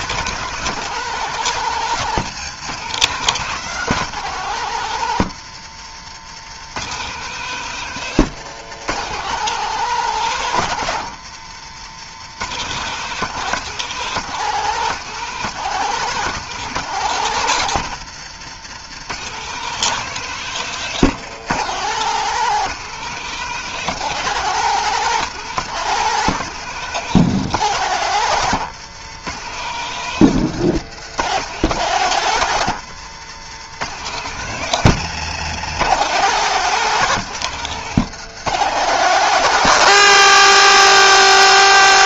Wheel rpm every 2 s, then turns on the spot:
170, 180, 140, 160, 170, 140, 170, 160, 160, 160, 170, 170, 170, 160, 150, 150, 150, 150, 160, 160, 170.
none